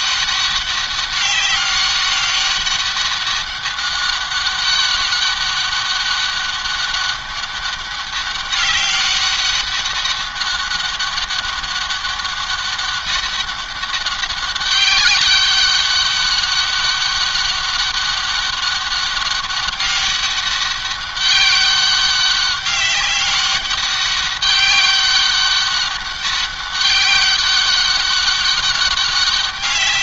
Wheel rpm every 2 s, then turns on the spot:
200, 190, 200, 200, 200, 200, 200, 200, 200, 200, 200, 190, 190, 200, 200.
none